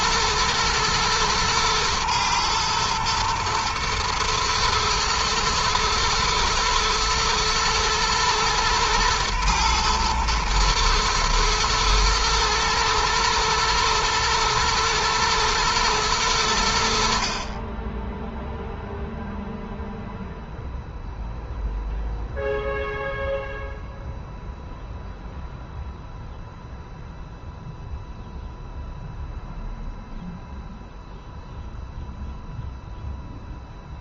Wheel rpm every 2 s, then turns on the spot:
110, 110, 120, 110, 110, 120, 110, 110, 60, 0, 0, 0, 0, 0, 0, 0, 0.
none